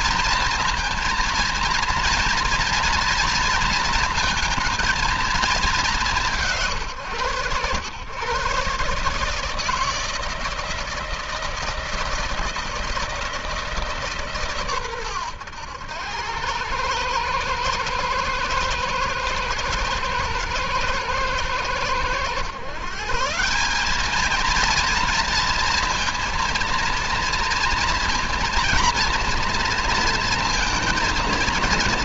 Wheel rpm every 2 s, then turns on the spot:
230, 230, 220, 140, 140, 160, 160, 120, 100, 110, 120, 130, 230, 230, 240, 230.
none